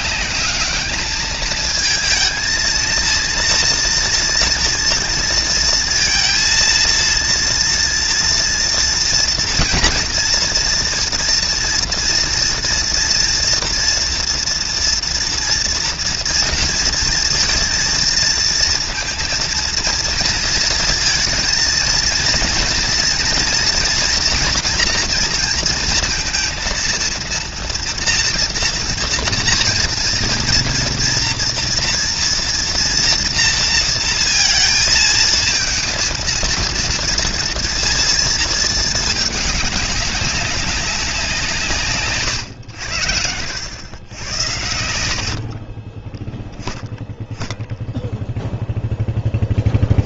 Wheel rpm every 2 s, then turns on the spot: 210, 230, 230, 230, 230, 230, 230, 240, 230, 230, 230, 230, 240, 230, 230, 230, 230, 230, 230, 230, 190, 110, 90, 0, 0.
44-46